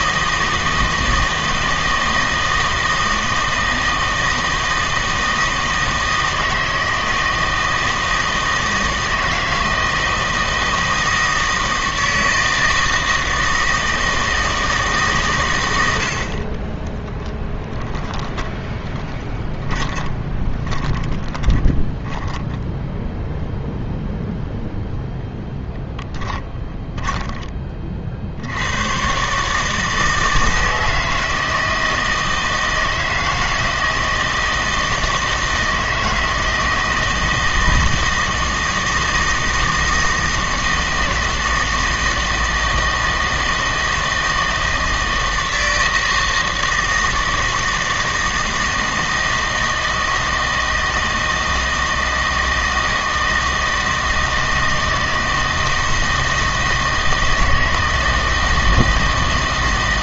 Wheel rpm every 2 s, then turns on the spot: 160, 160, 160, 160, 160, 160, 160, 160, 20, 10, 20, 10, 0, 20, 110, 160, 160, 160, 160, 160, 160, 160, 160, 160, 160, 160, 160, 160, 160, 160.
18-24 26-28